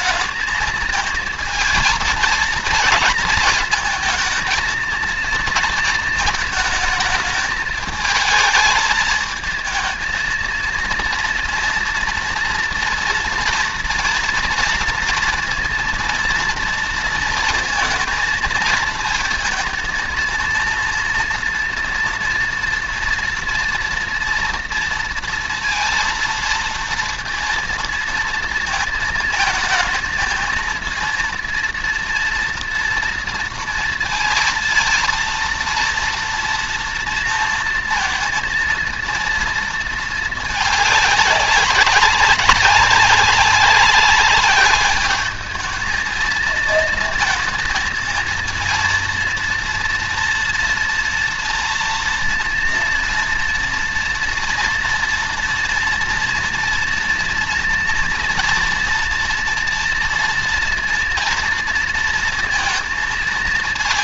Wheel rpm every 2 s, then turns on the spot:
220, 230, 230, 220, 220, 230, 230, 230, 230, 220, 230, 230, 230, 230, 230, 230, 230, 230, 230, 230, 220, 200, 200, 230, 230, 230, 230, 240, 230, 240, 230, 230.
none